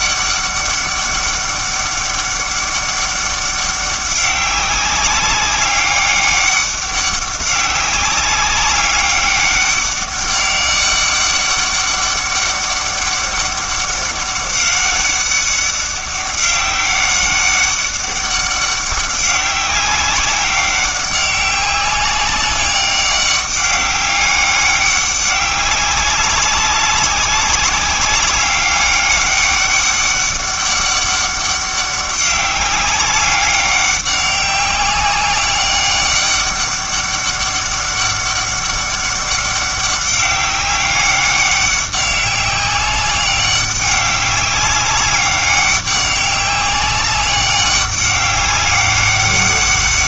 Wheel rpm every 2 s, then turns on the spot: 200, 200, 200, 200, 190, 200, 200, 200, 200, 200, 190, 200, 200, 200, 200, 200, 200, 200, 200, 200, 200, 200, 190, 200, 200.
none